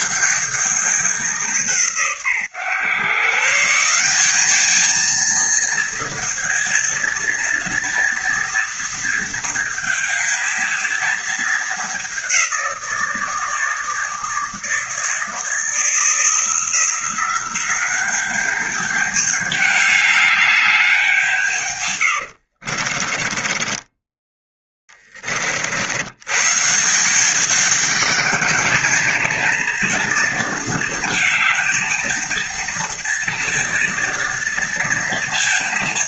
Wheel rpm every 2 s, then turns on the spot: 200, 130, 230, 230, 230, 220, 170, 160, 180, 210, 190, 40, 20, 180, 220, 230, 230, 230.
22-24